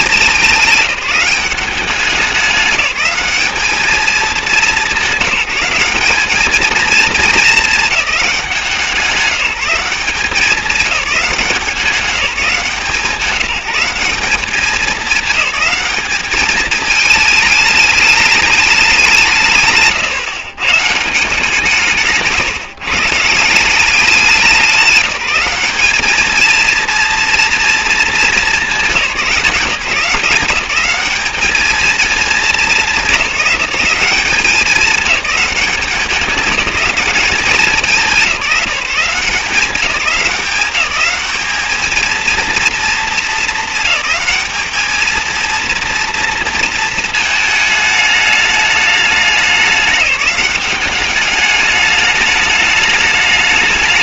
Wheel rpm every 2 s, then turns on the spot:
210, 200, 200, 210, 190, 200, 180, 210, 220, 210, 120, 150, 180, 220, 210, 190, 220, 200, 200, 180, 190, 230, 210, 230, 210, 200, 210.
none